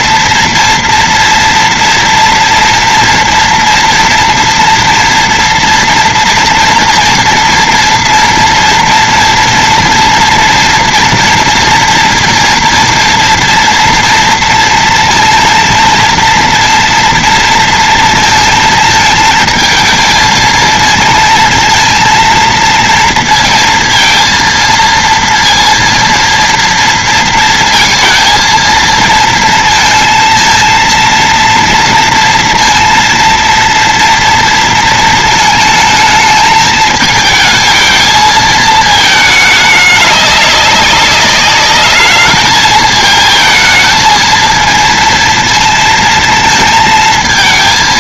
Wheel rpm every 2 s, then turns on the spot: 240, 230, 240, 240, 230, 230, 230, 230, 230, 230, 220, 230, 230, 230, 230, 230, 230, 230, 220, 220, 200, 220, 230, 220.
none